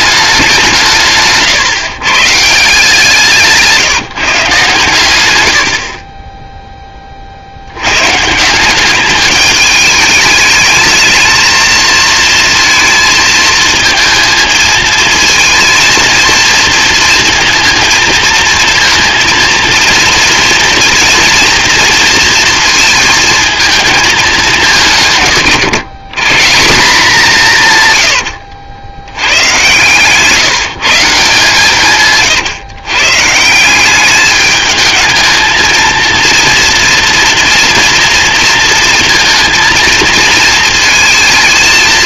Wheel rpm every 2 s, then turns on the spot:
180, 160, 140, 10, 170, 210, 230, 220, 230, 230, 230, 230, 180, 160, 80, 160, 120, 210, 230, 230, 230.
none